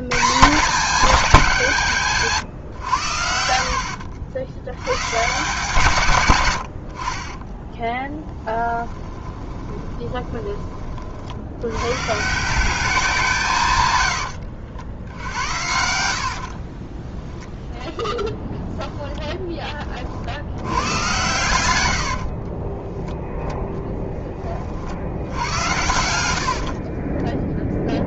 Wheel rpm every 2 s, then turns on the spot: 200, 130, 70, 80, 10, 30, 190, 80, 40, 10, 90, 20, 40, 50.
8-10 16-20 22-24 26-28